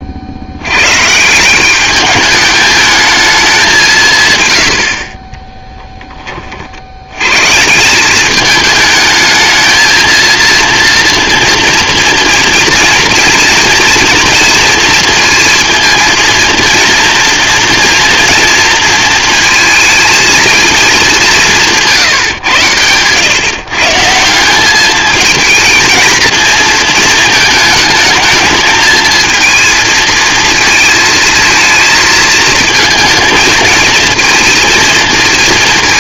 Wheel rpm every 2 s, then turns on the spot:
110, 220, 90, 60, 220, 230, 230, 230, 230, 230, 230, 110, 200, 220, 220, 220, 220, 230.
none